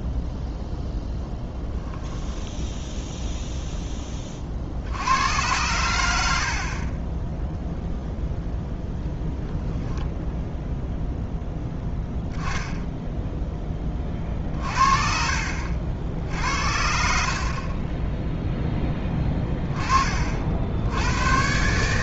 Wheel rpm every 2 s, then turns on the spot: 0, 0, 50, 50, 0, 0, 10, 50, 60, 10, 70.
none